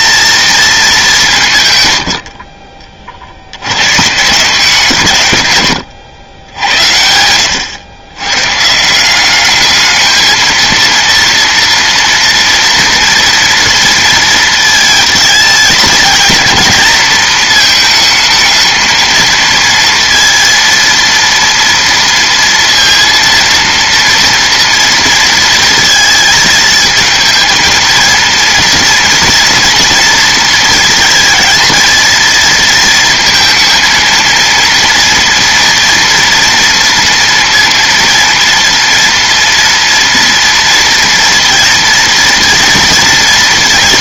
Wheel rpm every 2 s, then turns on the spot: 210, 40, 150, 80, 160, 230, 230, 220, 230, 220, 230, 230, 230, 220, 230, 220, 230, 230, 230, 230, 230, 230.
none